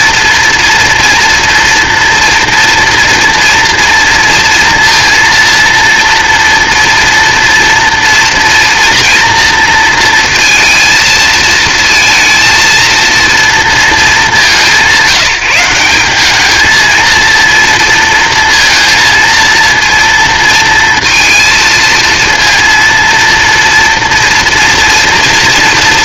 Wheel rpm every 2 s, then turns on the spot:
230, 230, 230, 230, 240, 220, 230, 180, 220, 230, 230, 230, 240.
none